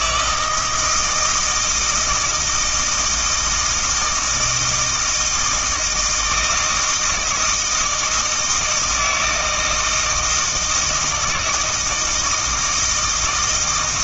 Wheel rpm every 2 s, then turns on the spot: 160, 160, 160, 160, 160, 160, 160.
none